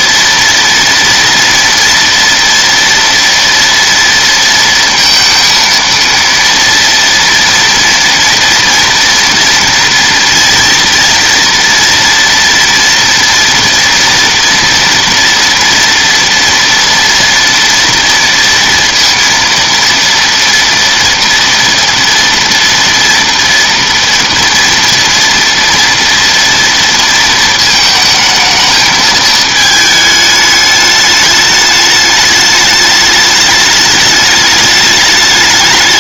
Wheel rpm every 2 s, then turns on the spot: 240, 230, 230, 230, 230, 230, 230, 240, 230, 230, 230, 230, 230, 230, 220, 210, 210, 210.
none